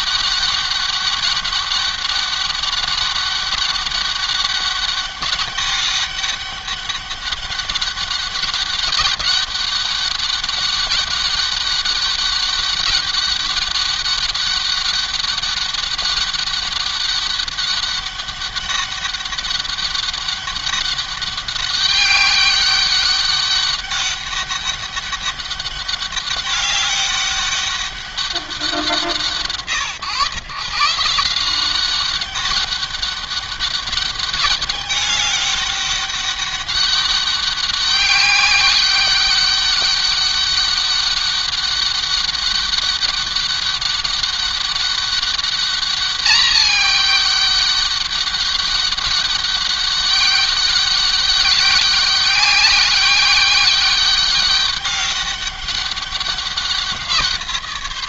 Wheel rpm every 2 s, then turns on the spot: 200, 200, 190, 200, 200, 200, 200, 200, 200, 200, 200, 200, 200, 200, 160, 180, 200, 200, 200, 200, 200, 200, 200, 200, 200, 200, 200, 200, 170.
none